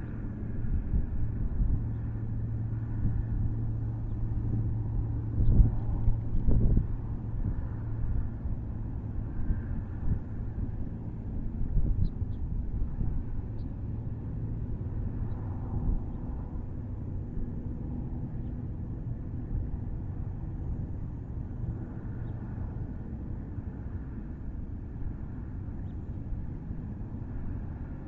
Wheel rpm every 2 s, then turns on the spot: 0, 0, 0, 0, 0, 0, 0, 0, 0, 0, 0, 0, 0, 0.
none